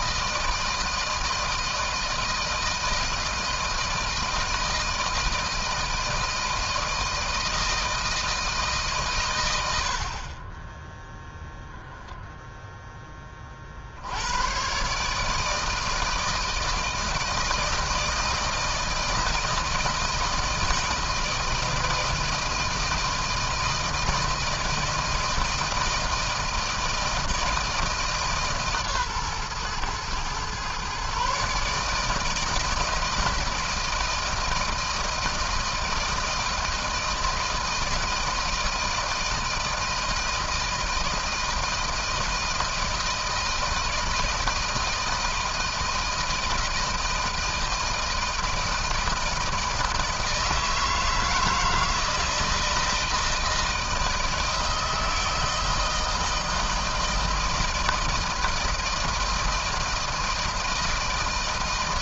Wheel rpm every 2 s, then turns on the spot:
160, 160, 160, 160, 150, 20, 10, 120, 160, 160, 160, 160, 160, 160, 140, 120, 160, 160, 160, 160, 160, 160, 160, 160, 160, 160, 160, 160, 160, 160, 160.
none